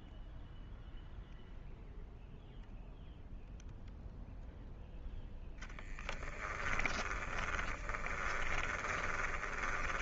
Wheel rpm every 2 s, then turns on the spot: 0, 0, 0, 10, 20.
6-10